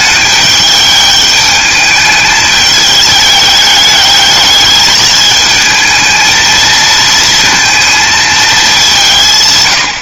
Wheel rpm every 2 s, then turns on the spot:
210, 210, 210, 230, 170.
none